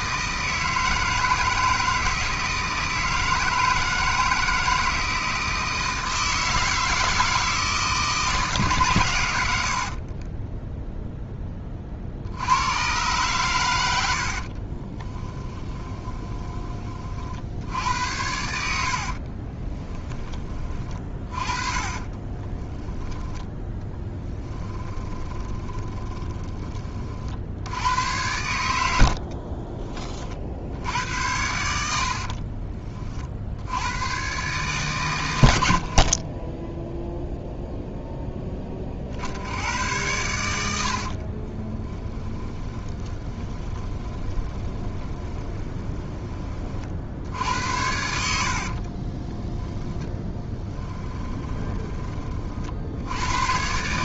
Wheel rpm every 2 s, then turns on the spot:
160, 160, 170, 160, 130, 0, 110, 30, 30, 60, 30, 10, 10, 30, 80, 80, 40, 140, 0, 30, 60, 20, 20, 50, 40, 10, 60.
14-16 18-20 22-26 28-30 42-46 48-52